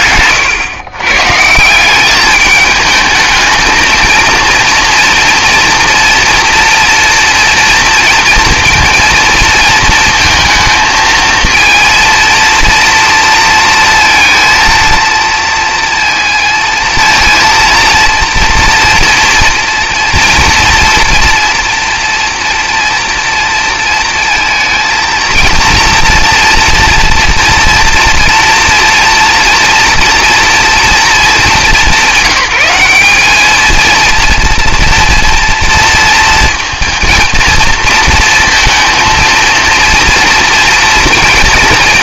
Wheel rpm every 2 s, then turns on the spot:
120, 210, 230, 230, 230, 230, 230, 230, 230, 240, 230, 230, 230, 230, 230, 230, 200, 230, 230, 230, 240.
none